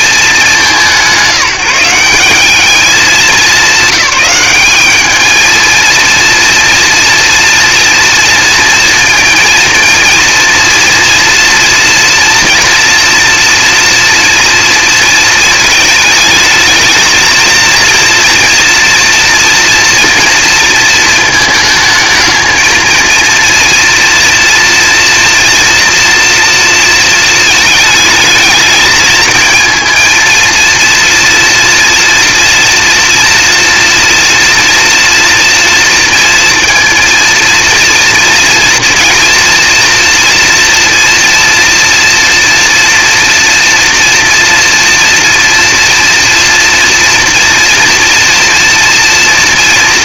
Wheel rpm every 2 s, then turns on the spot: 190, 190, 200, 230, 230, 230, 230, 240, 220, 230, 230, 220, 230, 230, 220, 230, 240, 240, 230, 230, 230, 230, 240, 230, 230.
none